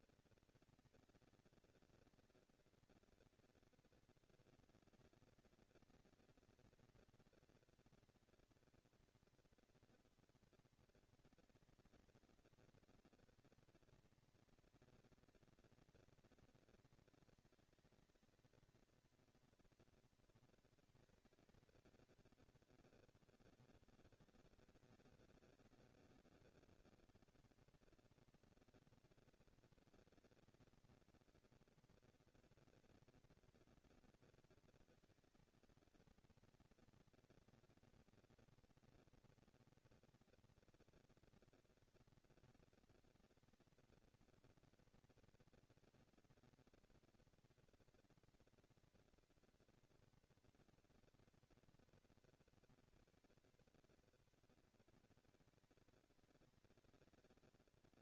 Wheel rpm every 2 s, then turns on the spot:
230, 230, 230, 230, 230, 230, 220, 230, 230, 230, 230, 220, 200, 200, 220, 230, 230, 230, 230, 230, 240, 230, 230, 230, 240, 230, 230, 230, 220.
none